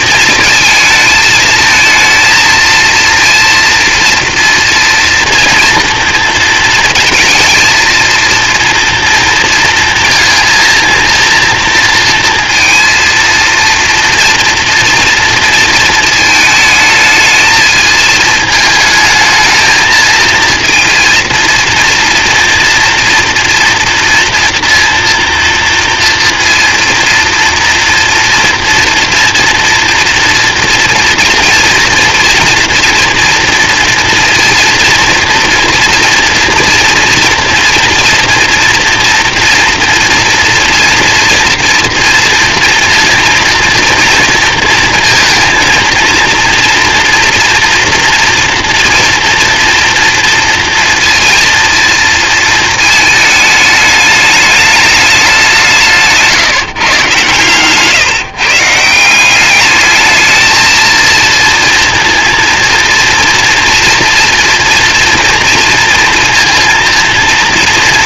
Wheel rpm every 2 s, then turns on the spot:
220, 230, 230, 230, 230, 230, 230, 230, 220, 220, 230, 230, 230, 230, 230, 230, 230, 230, 230, 230, 230, 230, 230, 230, 240, 230, 220, 210, 150, 170, 220, 230, 230, 230.
none